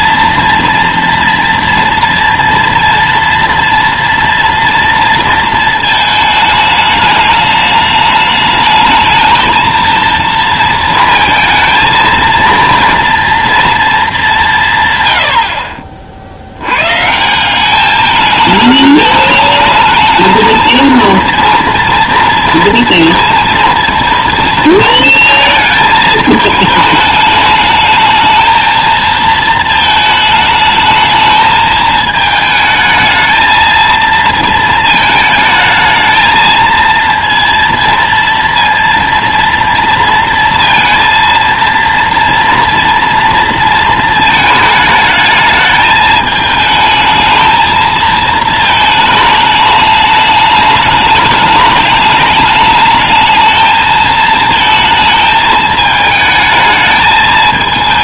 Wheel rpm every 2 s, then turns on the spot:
230, 230, 230, 210, 220, 230, 230, 160, 100, 220, 230, 230, 230, 220, 220, 220, 220, 220, 230, 230, 230, 230, 220, 220, 220, 210, 210, 220, 220.
none